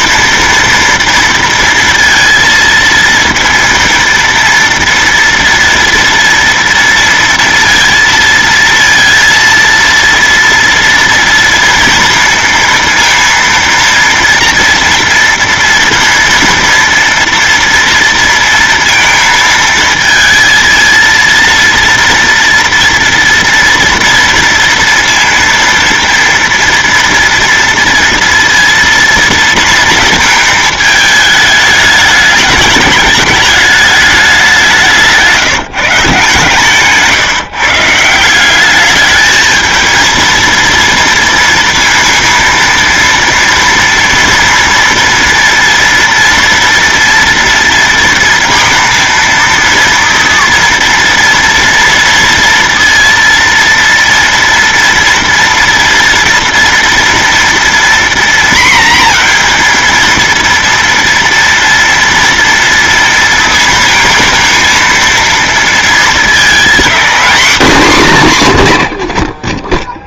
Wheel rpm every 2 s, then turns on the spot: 230, 230, 230, 230, 230, 230, 230, 230, 230, 230, 220, 230, 230, 230, 230, 220, 210, 200, 150, 180, 230, 230, 230, 230, 230, 230, 230, 230, 230, 240, 230, 230, 230, 220, 170.
none